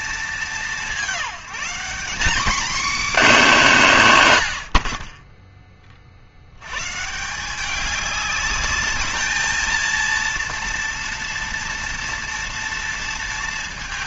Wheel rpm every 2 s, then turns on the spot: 200, 260, 90, 110, 210, 230, 230.
none